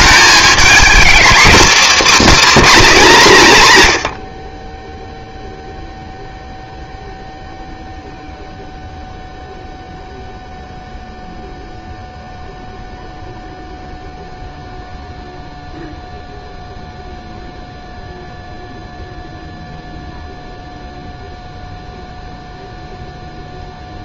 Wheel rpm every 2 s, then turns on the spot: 220, 270, 50, 0, 0, 0, 0, 0, 0, 0, 0, 0.
none